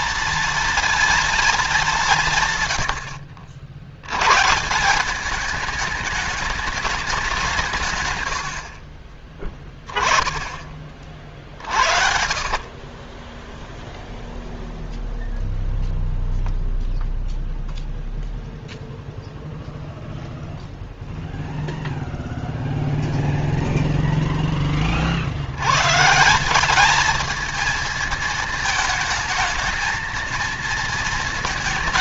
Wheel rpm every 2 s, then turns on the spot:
230, 100, 190, 200, 40, 30, 20, 0, 0, 0, 0, 0, 50, 210, 220, 230.
8-10 12-14